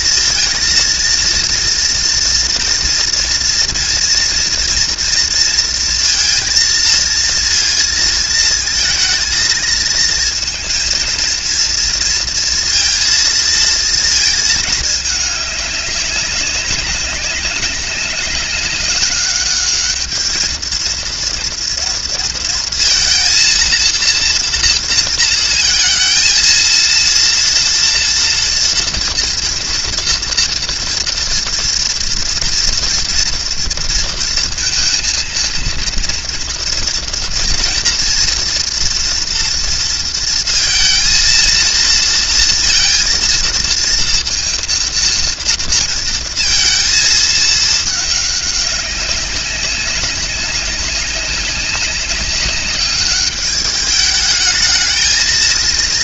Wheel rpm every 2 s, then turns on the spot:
230, 230, 230, 230, 220, 230, 230, 210, 200, 210, 230, 230, 230, 230, 240, 230, 230, 230, 230, 240, 230, 230, 230, 220, 200, 190, 200, 220.
none